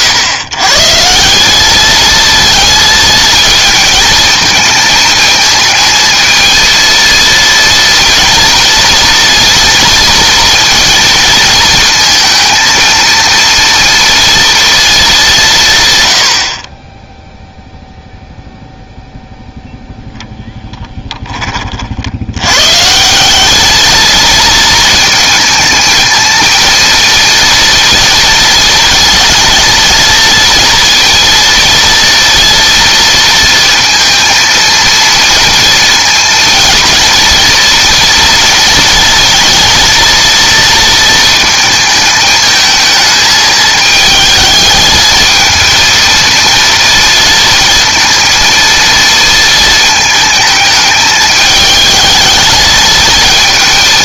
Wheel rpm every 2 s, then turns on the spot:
140, 220, 220, 230, 230, 230, 230, 230, 20, 0, 10, 140, 230, 230, 230, 230, 230, 230, 230, 230, 230, 220, 220, 230, 230, 220, 220.
none